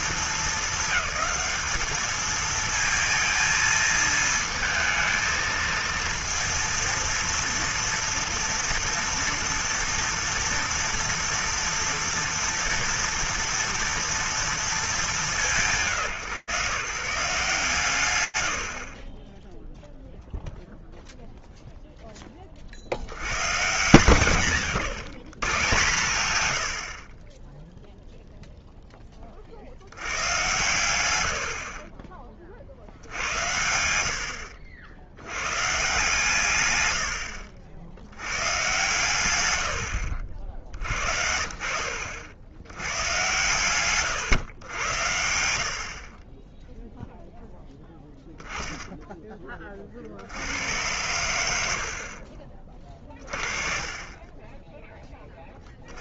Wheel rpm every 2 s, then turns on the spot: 220, 230, 230, 230, 240, 240, 230, 160, 140, 0, 0, 100, 110, 20, 10, 70, 70, 80, 100, 120, 50, 100, 100, 10, 10, 90, 30, 20.
38-40 46-48